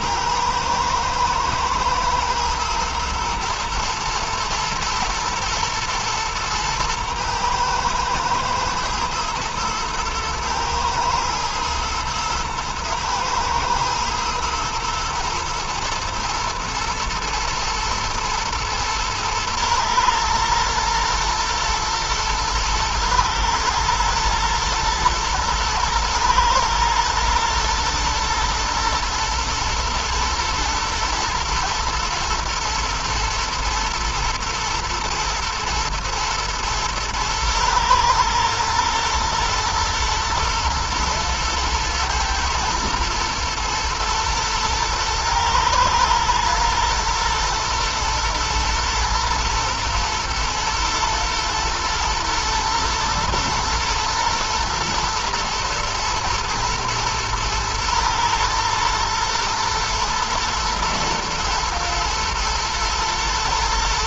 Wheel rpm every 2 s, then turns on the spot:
110, 110, 120, 110, 120, 120, 120, 120, 120, 120, 120, 120, 120, 120, 120, 110, 110, 110, 110, 120, 120, 110, 110, 110, 110, 120, 110, 120, 110, 120, 110, 110.
none